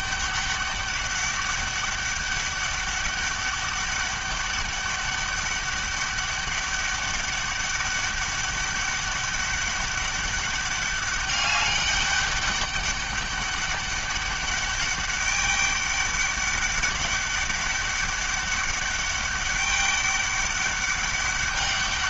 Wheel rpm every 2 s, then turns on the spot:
200, 200, 200, 200, 200, 200, 200, 200, 200, 200, 200.
none